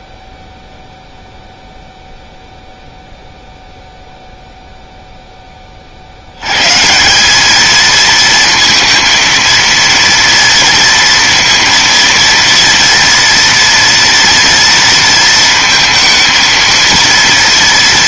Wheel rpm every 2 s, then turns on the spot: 0, 0, 0, 120, 230, 230, 230, 230, 230.
none